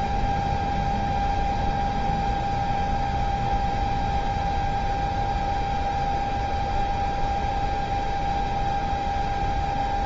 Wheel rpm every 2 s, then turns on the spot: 0, 0, 0, 0, 0.
none